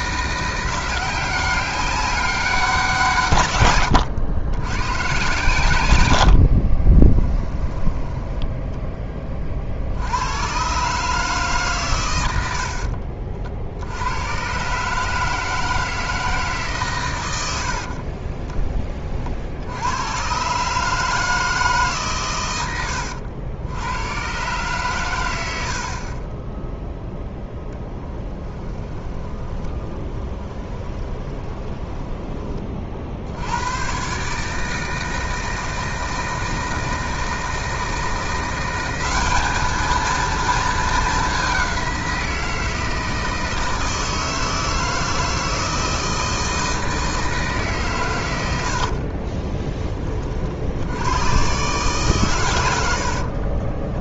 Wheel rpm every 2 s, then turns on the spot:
180, 170, 110, 40, 10, 130, 60, 140, 140, 20, 140, 100, 130, 0, 10, 20, 40, 160, 160, 190, 220, 160, 160, 160, 70, 80, 90.
6-8 12-14 28-32 52-54